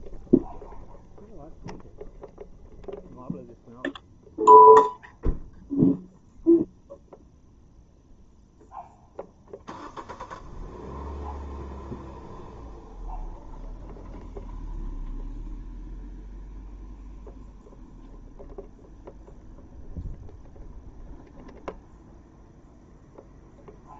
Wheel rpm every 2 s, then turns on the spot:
0, 0, 0, 0, 0, 0, 0, 0, 0, 0, 0, 0.
none